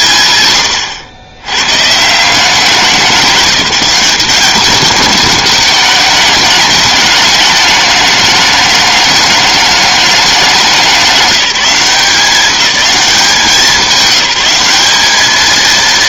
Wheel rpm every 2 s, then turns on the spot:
110, 190, 200, 210, 210, 190, 200, 200.
none